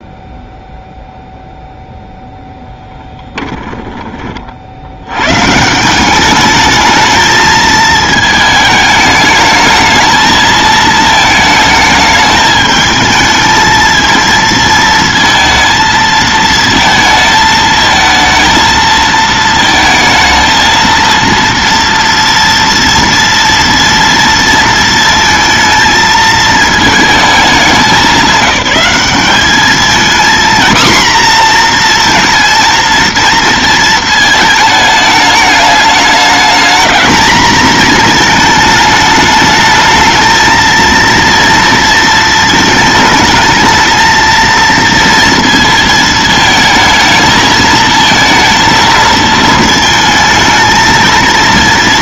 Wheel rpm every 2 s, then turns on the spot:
0, 0, 50, 210, 220, 220, 220, 220, 220, 220, 220, 230, 230, 220, 200, 240, 230, 210, 220, 220, 220, 220, 230, 220, 230, 220.
none